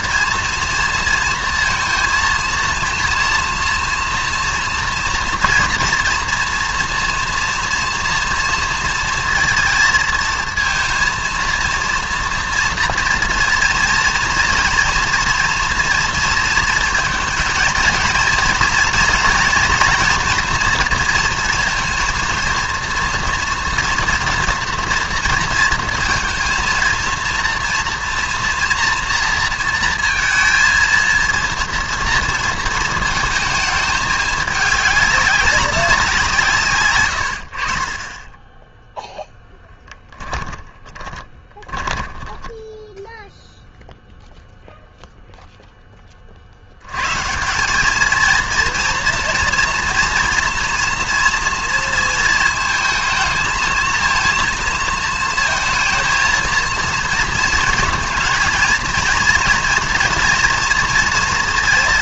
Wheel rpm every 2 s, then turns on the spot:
230, 230, 230, 240, 230, 230, 230, 230, 230, 230, 230, 240, 240, 230, 230, 230, 230, 210, 150, 20, 30, 10, 0, 70, 230, 240, 220, 220, 230, 230, 230.
38-44